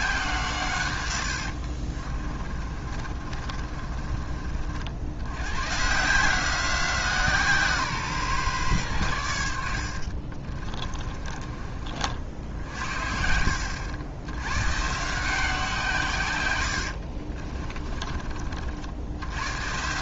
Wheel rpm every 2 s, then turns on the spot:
110, 30, 60, 170, 110, 30, 60, 130, 70, 60.
2-4 10-12 16-18